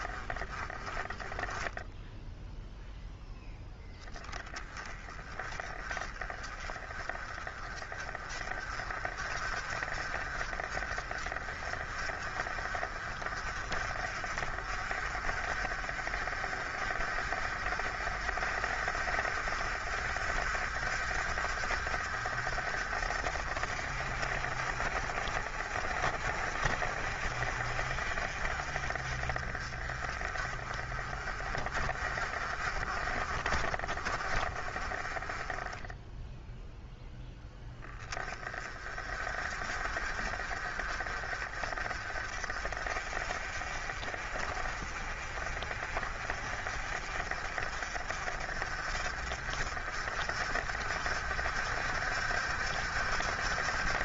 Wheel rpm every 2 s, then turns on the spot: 10, 0, 10, 30, 40, 40, 40, 40, 50, 50, 60, 50, 50, 50, 40, 40, 40, 40, 0, 30, 40, 40, 40, 40, 50, 60, 60.
none